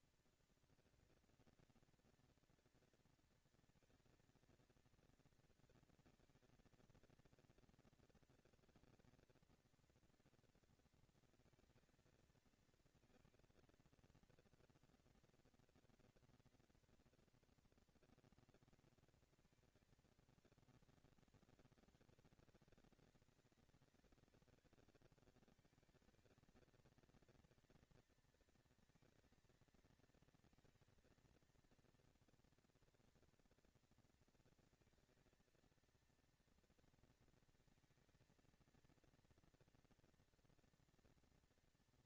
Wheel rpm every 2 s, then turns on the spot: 230, 230, 230, 230, 230, 230, 230, 230, 230, 230, 210, 190, 200, 220, 230, 230, 230, 230, 230, 230, 230.
none